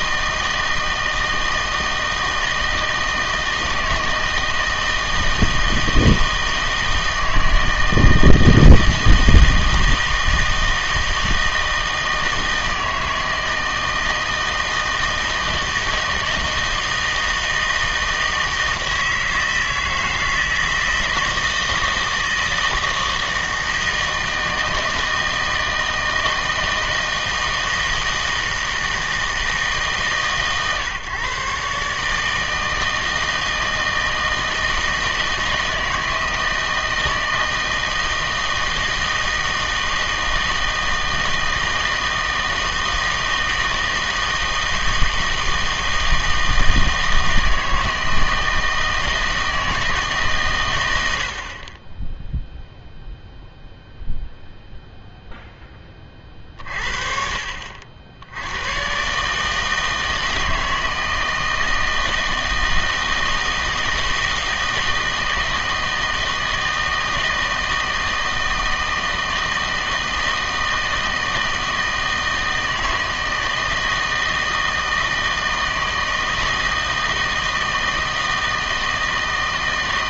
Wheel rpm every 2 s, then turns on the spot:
160, 160, 160, 160, 160, 160, 160, 160, 160, 160, 160, 160, 160, 160, 160, 130, 160, 160, 160, 160, 160, 160, 160, 160, 160, 110, 0, 0, 40, 100, 160, 160, 160, 160, 160, 160, 160, 160, 160, 160.
none